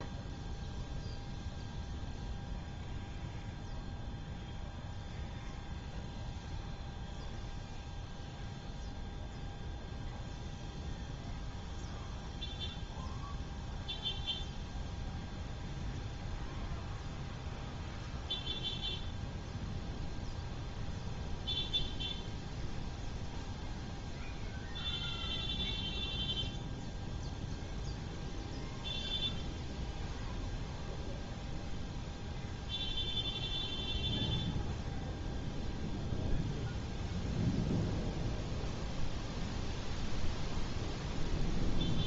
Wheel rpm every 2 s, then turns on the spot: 0, 0, 0, 0, 0, 0, 0, 0, 0, 0, 0, 0, 0, 0, 0, 0, 0, 0, 0, 0, 0.
none